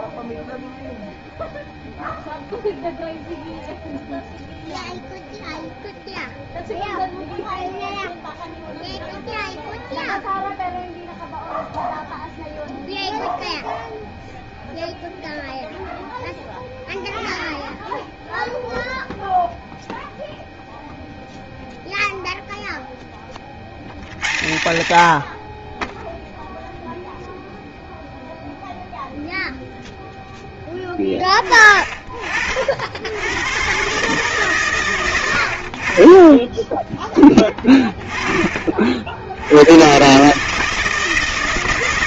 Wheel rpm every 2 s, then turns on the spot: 0, 0, 0, 0, 0, 0, 0, 0, 0, 0, 0, 0, 90, 0, 0, 20, 60, 130, 10, 50, 150.
none